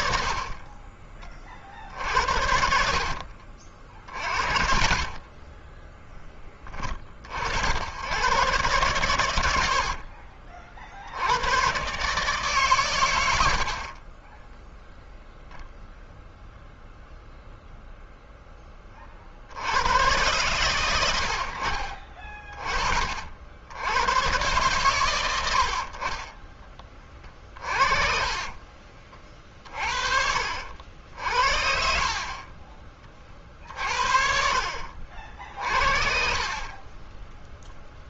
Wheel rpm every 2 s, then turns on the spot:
30, 60, 50, 30, 120, 80, 100, 0, 0, 30, 90, 50, 110, 30, 40, 70, 40, 60, 20.
4-6 8-10 26-28 30-32